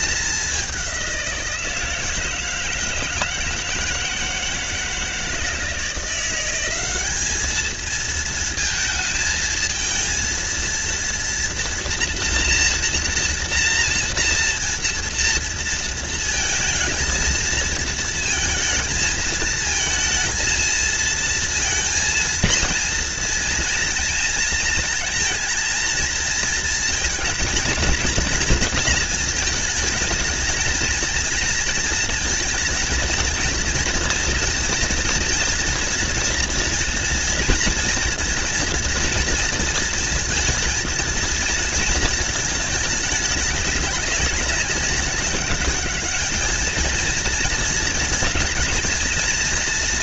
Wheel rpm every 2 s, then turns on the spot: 190, 160, 170, 200, 220, 230, 230, 230, 220, 220, 220, 230, 230, 220, 220, 230, 230, 230, 230, 230, 230, 200, 200, 220, 230.
none